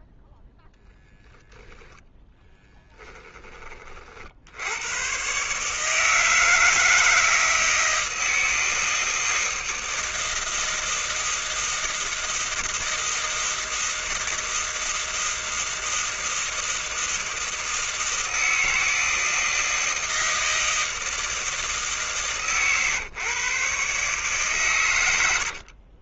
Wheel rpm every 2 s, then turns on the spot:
0, 10, 110, 160, 160, 160, 160, 160, 160, 160, 160, 140, 110.
2-4